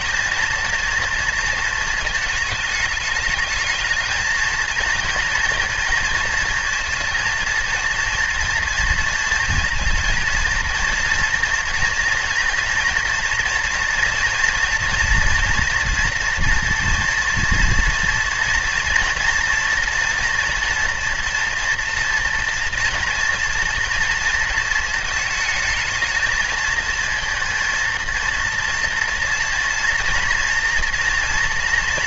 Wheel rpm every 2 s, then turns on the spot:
220, 210, 230, 230, 230, 230, 230, 230, 230, 230, 230, 230, 220, 230, 230, 230.
none